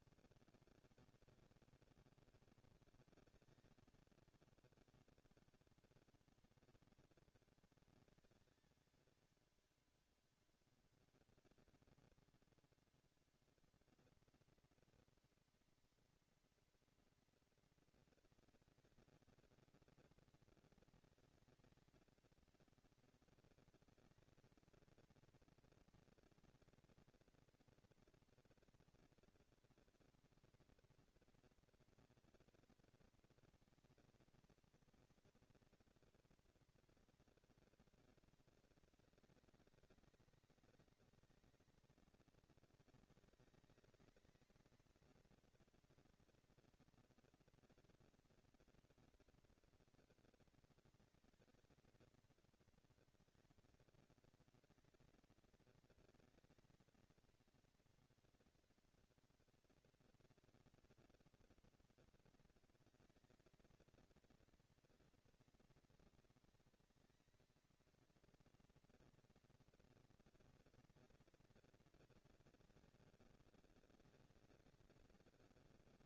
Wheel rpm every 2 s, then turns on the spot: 200, 200, 200, 200, 200, 200, 200, 230, 230, 230, 220, 230, 230, 230, 230, 230, 230, 230, 230, 200, 200, 210, 230, 230, 230, 230, 230, 230, 230, 240, 230, 230, 230, 230, 230, 230, 210, 190.
none